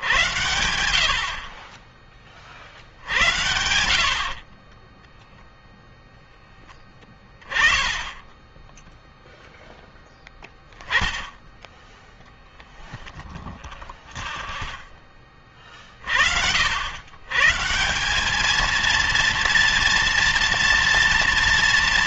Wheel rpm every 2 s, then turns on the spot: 90, 40, 20, 10, 0, 10, 10, 10, 100, 220, 230.
none